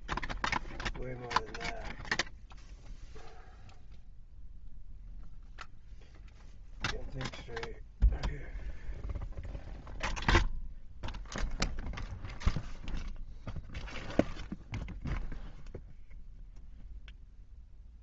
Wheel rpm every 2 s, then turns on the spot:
0, 0, 0, 0, 0, 0, 0, 0, 0.
none